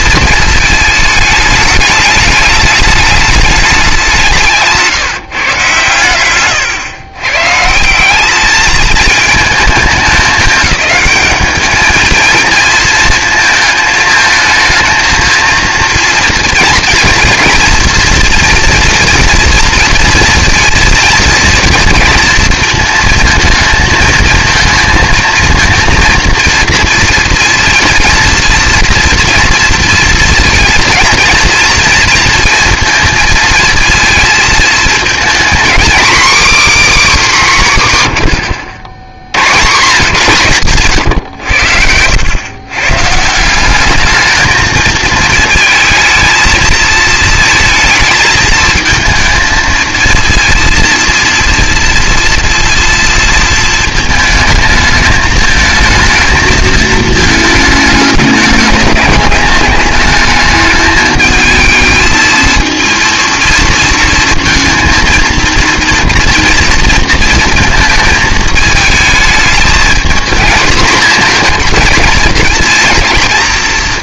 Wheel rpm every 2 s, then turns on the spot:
220, 210, 170, 120, 210, 210, 220, 220, 230, 230, 230, 230, 230, 230, 230, 230, 230, 230, 280, 90, 150, 130, 220, 220, 230, 230, 230, 220, 220, 210, 210, 230, 230, 230, 220, 230, 230.
6-8 38-40